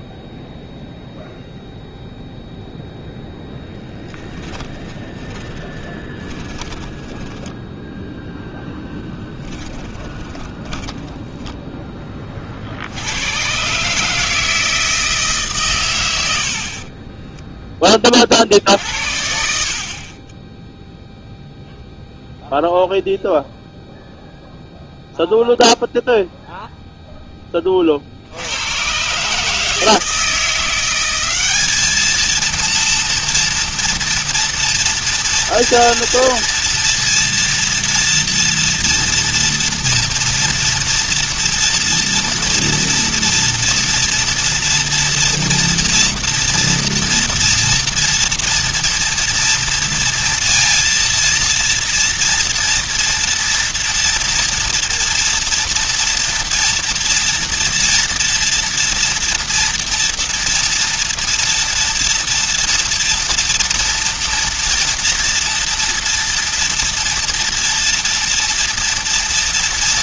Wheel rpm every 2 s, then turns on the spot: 0, 0, 20, 10, 10, 10, 100, 160, 20, 60, 0, 0, 0, 10, 140, 190, 230, 230, 230, 230, 230, 230, 230, 230, 230, 230, 230, 230, 230, 230, 230, 230, 230, 230, 240.
4-12 16-18